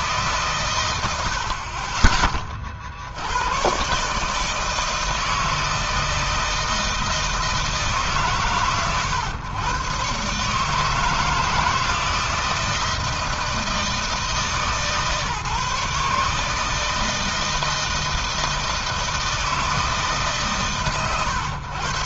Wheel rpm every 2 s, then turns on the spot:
120, 40, 150, 160, 130, 150, 160, 150, 150, 160, 130.
none